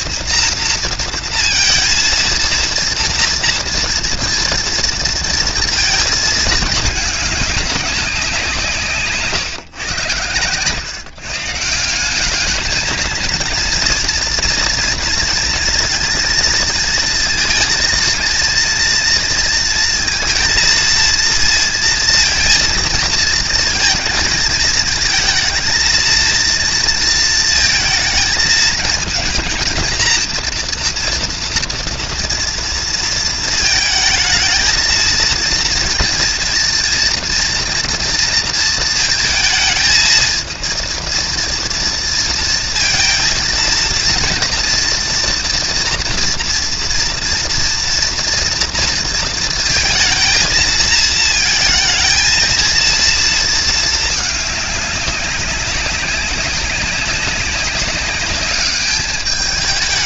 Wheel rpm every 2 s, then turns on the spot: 230, 230, 230, 210, 150, 150, 220, 230, 230, 230, 230, 230, 230, 230, 220, 230, 230, 230, 230, 220, 230, 230, 230, 230, 230, 220, 230, 200, 200, 210.
none